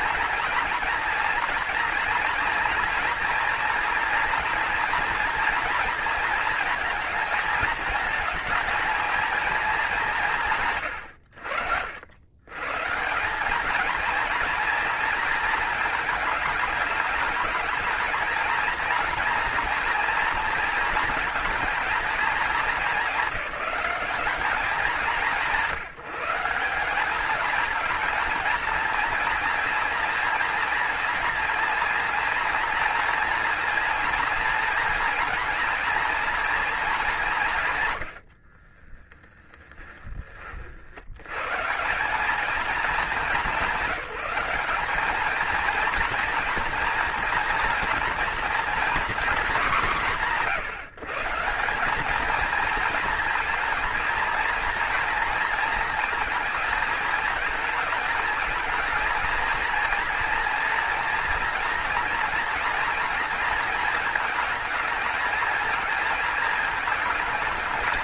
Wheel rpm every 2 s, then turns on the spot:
240, 230, 230, 220, 220, 120, 160, 220, 210, 240, 220, 200, 190, 190, 230, 230, 230, 240, 200, 30, 80, 210, 200, 230, 240, 160, 230, 230, 220, 230, 240, 230, 220, 220.
38-40